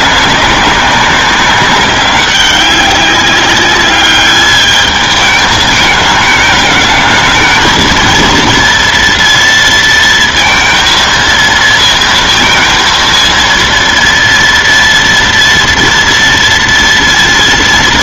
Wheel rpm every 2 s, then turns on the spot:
190, 190, 210, 220, 230, 230, 230, 240, 230.
none